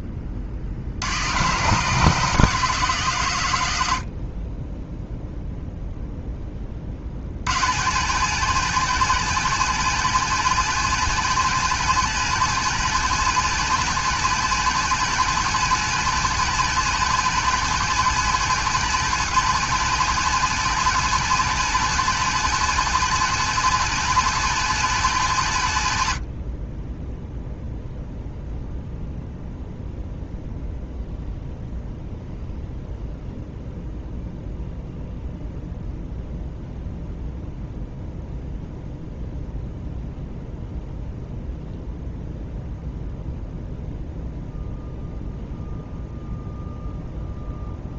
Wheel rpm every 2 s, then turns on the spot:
40, 160, 0, 30, 170, 180, 170, 170, 180, 180, 180, 180, 180, 30, 0, 0, 0, 0, 0, 0, 0, 0, 0, 0.
none